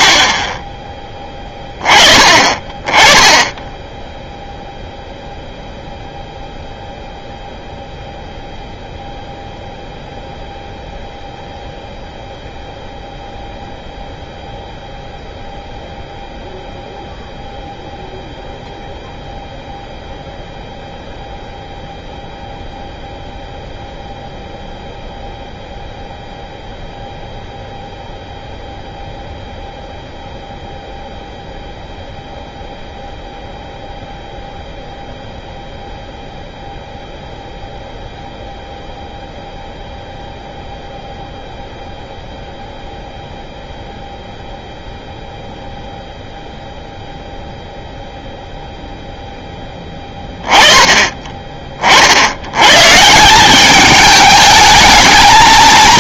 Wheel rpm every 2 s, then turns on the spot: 10, 20, 0, 0, 0, 0, 0, 0, 0, 0, 0, 0, 0, 0, 0, 0, 0, 0, 0, 0, 0, 0, 0, 0, 0, 20, 110, 210.
none